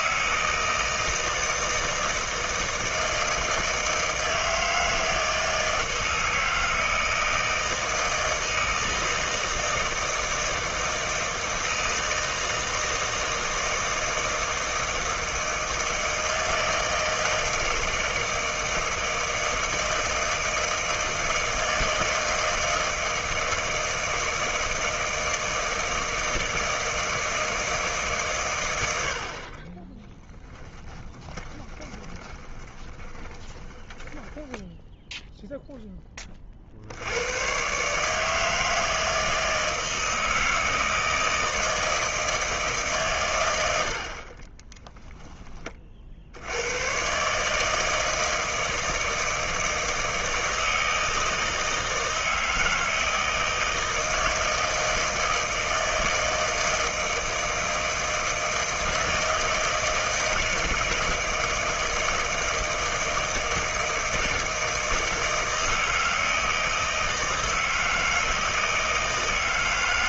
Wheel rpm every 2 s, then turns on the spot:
160, 160, 160, 160, 160, 160, 160, 160, 160, 160, 160, 160, 160, 160, 110, 10, 20, 10, 60, 160, 160, 160, 20, 100, 160, 160, 160, 160, 160, 160, 160, 160, 160, 160, 160.
30-34 44-46